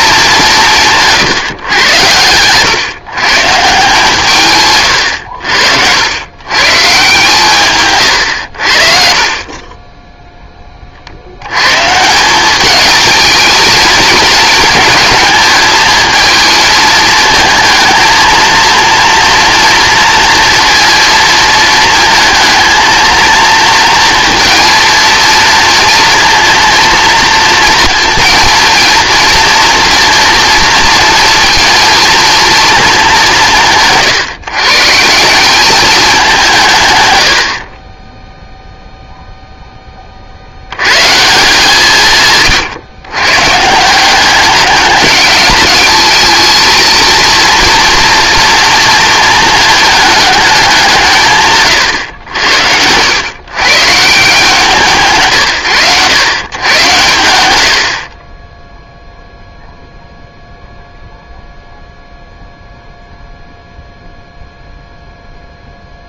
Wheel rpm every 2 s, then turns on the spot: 170, 130, 140, 140, 70, 20, 210, 220, 220, 230, 230, 220, 230, 240, 230, 230, 230, 140, 150, 0, 90, 130, 200, 230, 230, 190, 80, 160, 120, 0, 0, 0, 0.
none